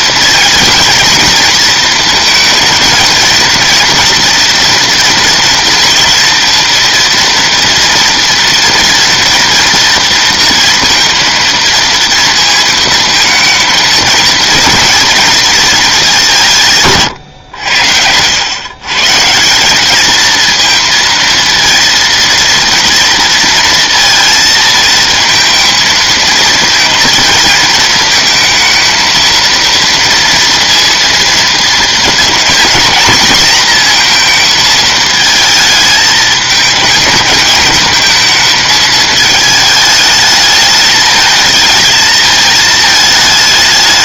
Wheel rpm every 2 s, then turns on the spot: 230, 230, 240, 230, 230, 230, 230, 230, 150, 130, 230, 230, 220, 230, 230, 230, 240, 220, 220, 220, 210, 220.
none